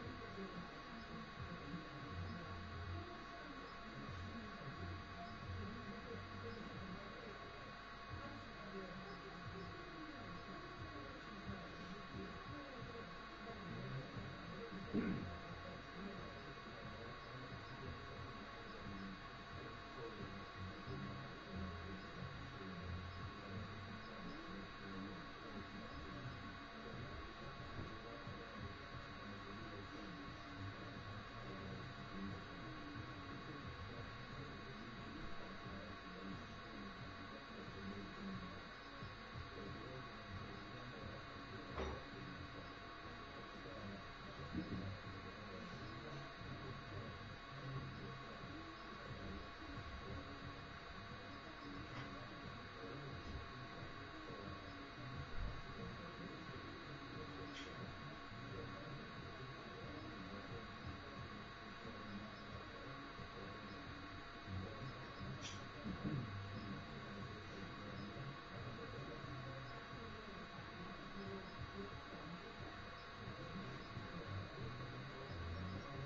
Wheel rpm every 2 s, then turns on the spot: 0, 0, 0, 0, 0, 0, 0, 0, 0, 0, 0, 0, 0, 0, 0, 0, 0, 0, 0, 0, 0, 0, 0, 0, 0, 0, 0, 0, 0, 0, 0, 0, 0, 0, 0, 0, 0, 0.
none